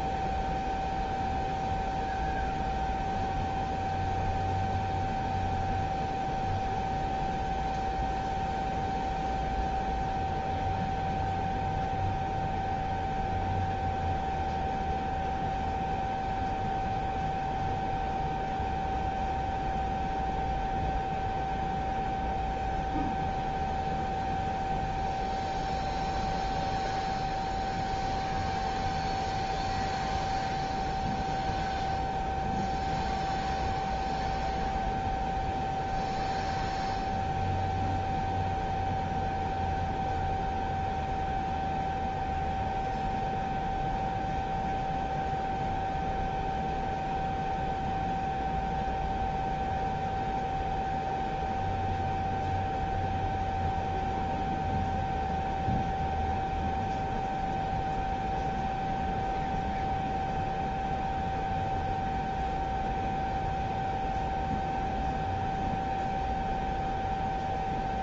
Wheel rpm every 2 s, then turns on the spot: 0, 0, 0, 0, 0, 0, 0, 0, 0, 0, 0, 0, 0, 0, 0, 0, 0, 0, 0, 0, 0, 0, 0, 0, 0, 0, 0, 0, 0, 0, 0, 0, 0, 0.
none